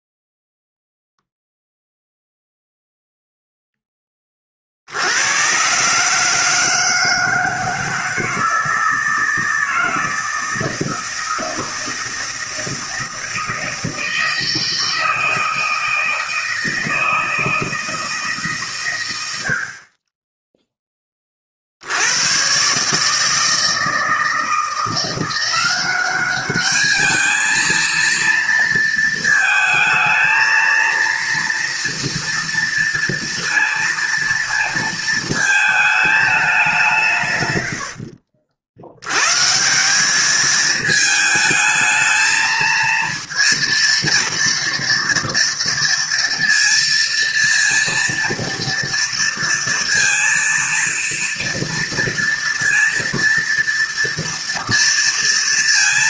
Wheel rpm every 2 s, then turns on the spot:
0, 0, 40, 160, 160, 160, 160, 160, 160, 140, 10, 130, 160, 200, 230, 230, 230, 230, 170, 70, 220, 220, 230, 230, 230, 230, 230, 230.
none